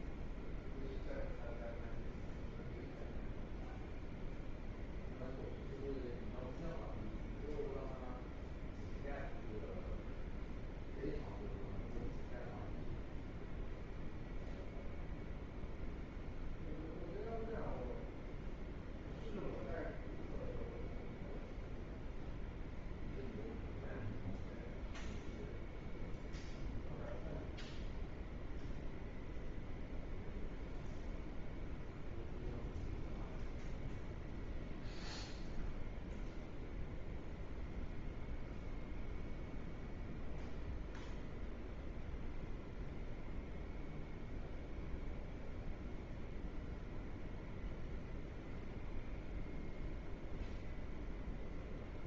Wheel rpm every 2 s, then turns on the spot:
0, 0, 0, 0, 0, 0, 0, 0, 0, 0, 0, 0, 0, 0, 0, 0, 0, 0, 0, 0, 0, 0, 0, 0, 0, 0.
none